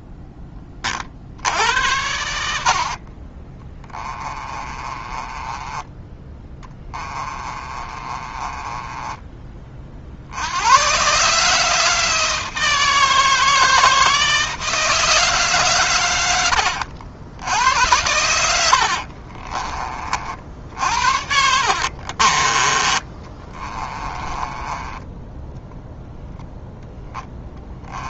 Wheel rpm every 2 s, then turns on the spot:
40, 50, 20, 20, 20, 120, 160, 160, 80, 60, 60, 20, 20, 10.
2-10 18-26